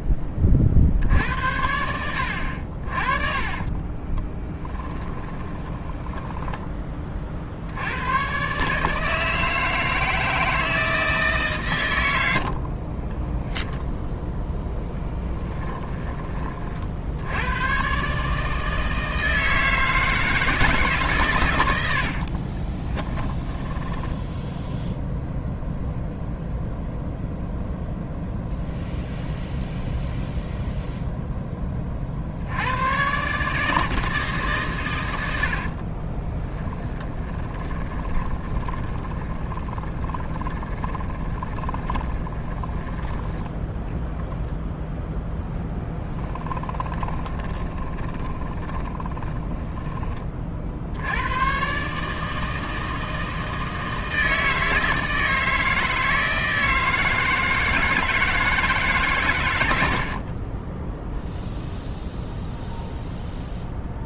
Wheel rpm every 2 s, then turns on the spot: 40, 50, 20, 20, 140, 160, 50, 0, 40, 160, 150, 30, 0, 0, 0, 0, 90, 130, 10, 20, 20, 10, 0, 20, 30, 60, 160, 160, 160, 150, 20, 0.
4-6 12-14 22-24 36-42 46-50 60-62